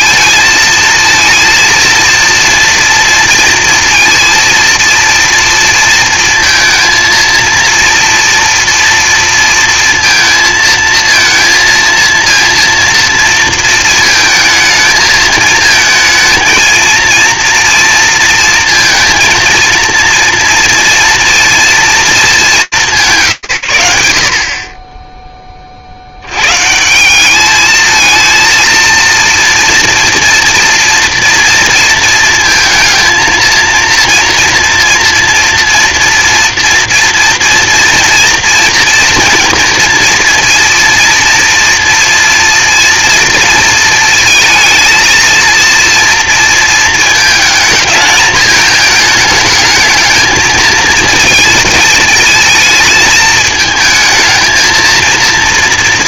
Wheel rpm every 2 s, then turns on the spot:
230, 230, 230, 220, 230, 220, 230, 220, 230, 230, 230, 210, 80, 120, 230, 240, 230, 230, 230, 230, 230, 230, 230, 230, 220, 220, 220, 230.
none